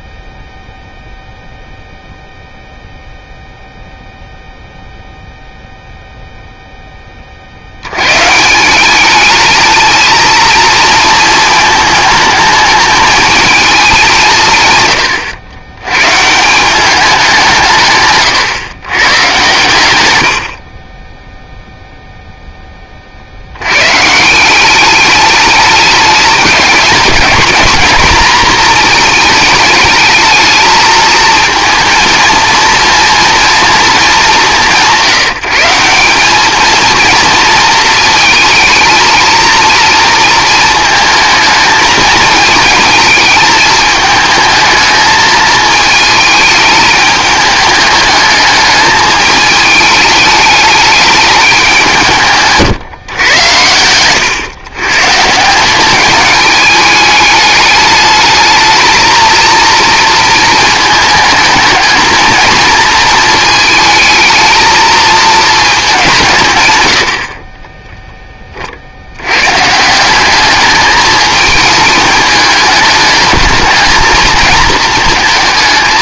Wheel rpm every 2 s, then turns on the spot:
0, 0, 0, 0, 160, 220, 220, 150, 170, 120, 60, 10, 180, 210, 230, 220, 230, 180, 210, 220, 230, 220, 220, 220, 210, 210, 150, 120, 210, 220, 220, 220, 220, 130, 30, 210, 210, 220.
20-22